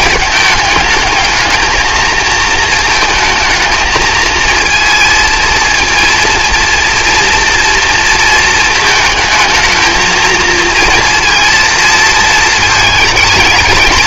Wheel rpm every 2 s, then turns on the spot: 220, 220, 230, 230, 220, 230, 220.
none